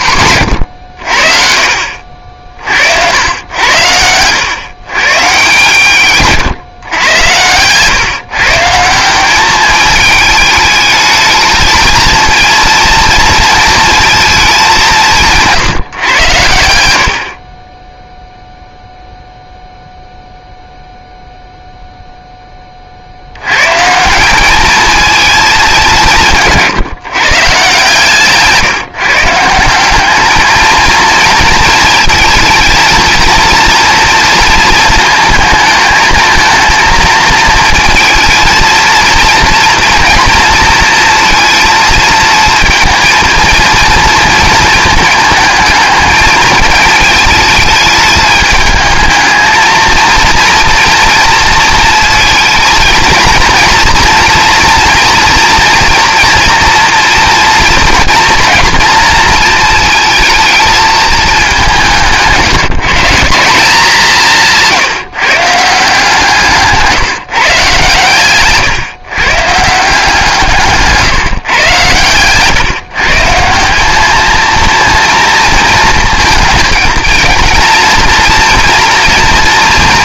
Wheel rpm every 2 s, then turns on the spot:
90, 70, 120, 130, 160, 220, 230, 200, 80, 0, 0, 30, 210, 150, 150, 220, 220, 230, 220, 220, 230, 230, 220, 220, 210, 230, 230, 230, 230, 240, 220, 160, 170, 160, 130, 150, 150, 230, 230, 240.
64-66 70-72